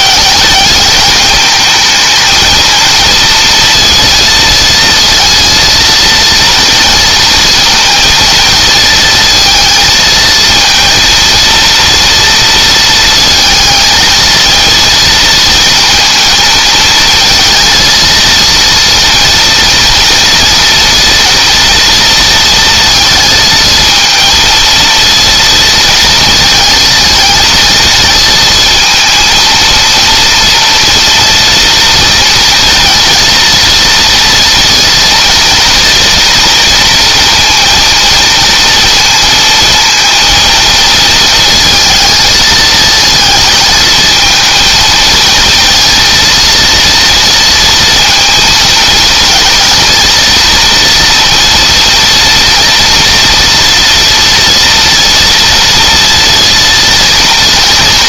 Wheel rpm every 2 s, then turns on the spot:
210, 230, 230, 230, 230, 230, 230, 230, 220, 230, 240, 230, 230, 220, 230, 240, 230, 230, 230, 230, 230, 220, 220, 230, 220, 230, 230, 230, 230.
none